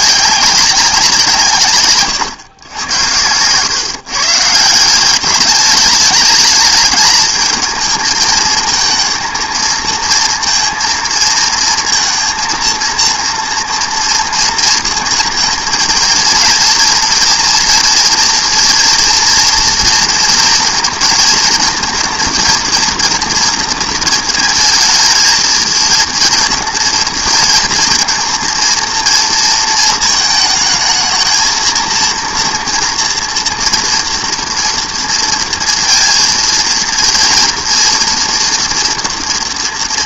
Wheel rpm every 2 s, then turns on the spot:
200, 100, 160, 210, 220, 230, 230, 230, 230, 230, 230, 230, 230, 230, 230, 220, 230, 230, 230, 230.
none